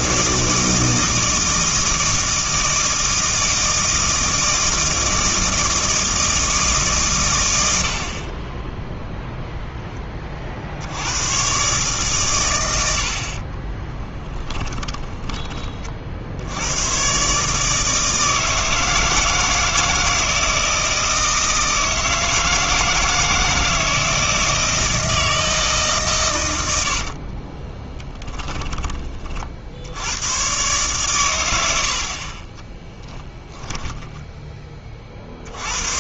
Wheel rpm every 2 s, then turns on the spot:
160, 160, 160, 150, 10, 60, 100, 20, 90, 160, 160, 160, 160, 90, 20, 120, 10, 20.
8-10 14-16 28-30 32-34